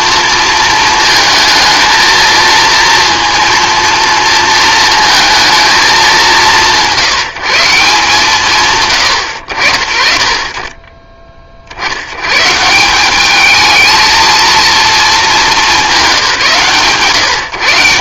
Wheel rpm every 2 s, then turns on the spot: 230, 230, 220, 180, 150, 30, 170, 230, 140.
none